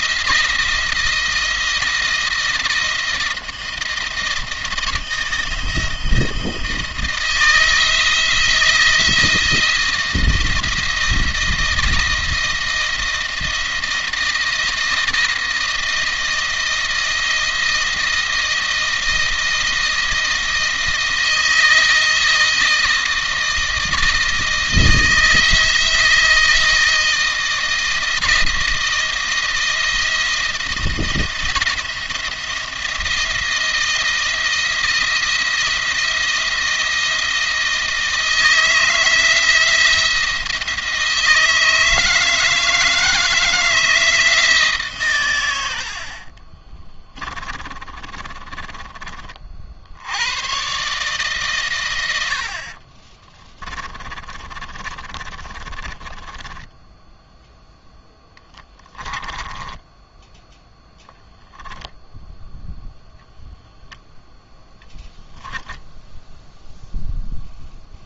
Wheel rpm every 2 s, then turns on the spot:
160, 160, 160, 160, 160, 170, 160, 160, 160, 160, 160, 160, 160, 160, 160, 170, 170, 170, 170, 160, 160, 160, 150, 30, 30, 130, 50, 30, 10, 10, 0, 0, 0, 0.
46-50 52-60